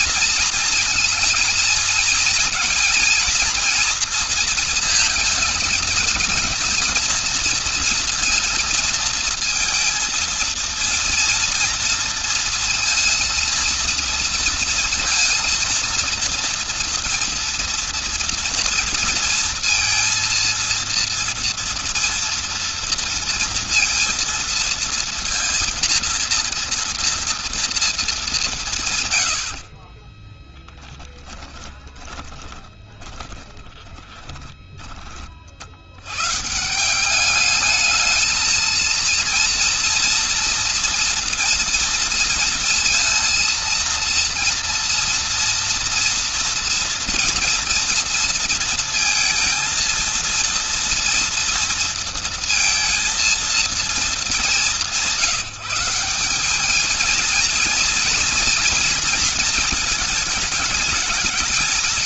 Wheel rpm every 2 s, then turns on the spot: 230, 230, 230, 230, 220, 230, 230, 230, 230, 230, 230, 230, 230, 230, 180, 20, 20, 20, 140, 220, 240, 230, 230, 230, 230, 230, 230, 200, 210, 240, 210.
30-36